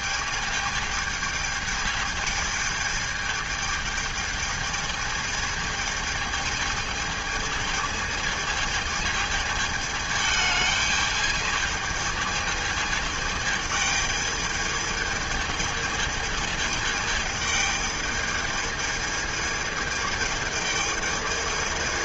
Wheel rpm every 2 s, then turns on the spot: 220, 220, 220, 220, 220, 210, 220, 210, 220, 210, 220.
none